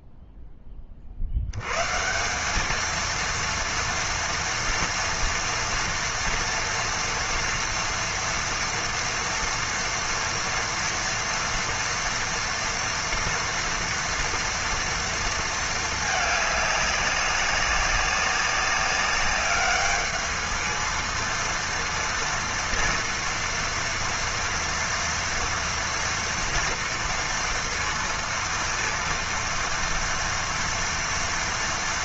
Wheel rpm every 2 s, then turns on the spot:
10, 190, 230, 230, 240, 230, 230, 230, 210, 200, 220, 240, 230, 230, 230, 230.
none